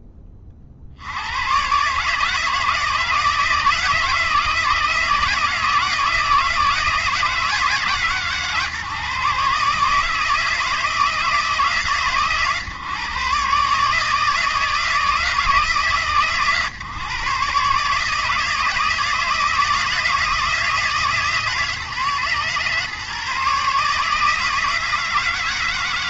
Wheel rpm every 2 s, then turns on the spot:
90, 160, 160, 160, 140, 160, 130, 160, 130, 160, 160, 140, 160.
none